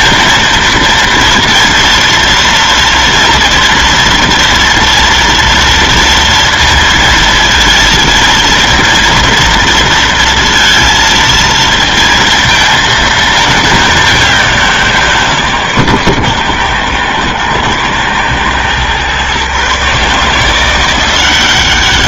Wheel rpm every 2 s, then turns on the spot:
230, 230, 230, 230, 230, 230, 220, 170, 110, 120, 170.
none